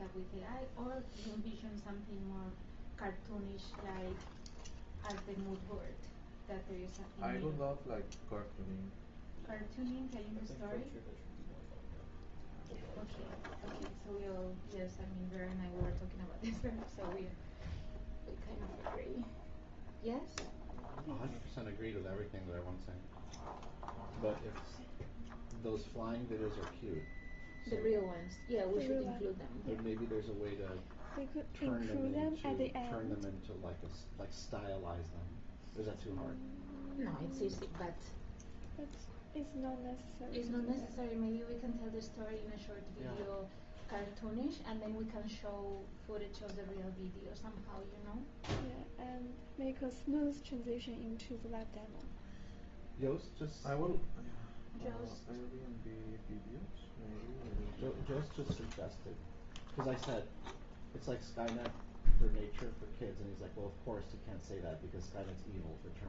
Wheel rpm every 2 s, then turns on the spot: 0, 0, 0, 0, 0, 0, 0, 0, 0, 0, 0, 0, 0, 0, 0, 0, 0, 0, 0, 0, 0, 0, 0, 0, 0, 0, 0, 0, 0, 0, 0, 0, 0.
none